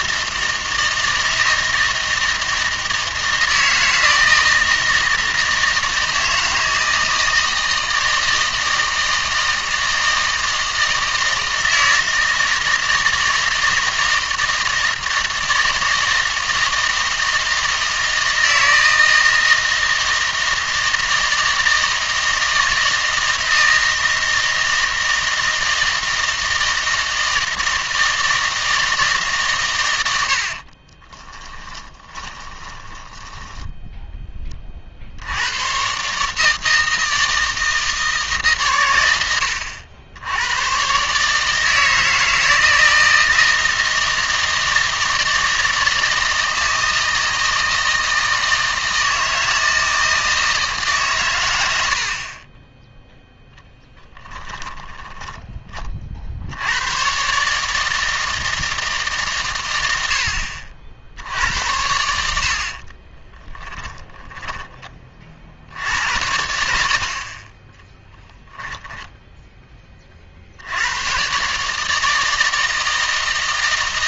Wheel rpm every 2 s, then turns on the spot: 160, 160, 160, 160, 160, 160, 160, 160, 160, 160, 160, 160, 160, 160, 160, 60, 10, 30, 160, 130, 110, 160, 160, 160, 160, 160, 20, 10, 80, 160, 50, 50, 10, 70, 10, 80, 160.
30-34 54-56 68-70